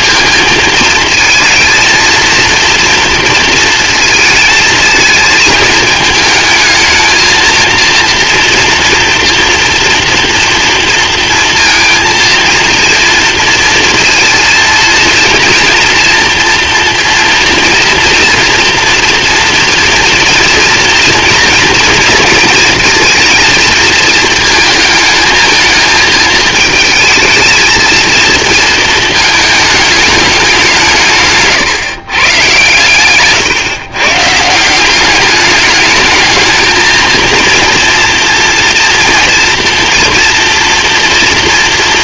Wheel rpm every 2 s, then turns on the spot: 230, 230, 230, 220, 230, 230, 230, 230, 240, 240, 230, 230, 220, 220, 230, 190, 130, 160, 220, 230, 230.
none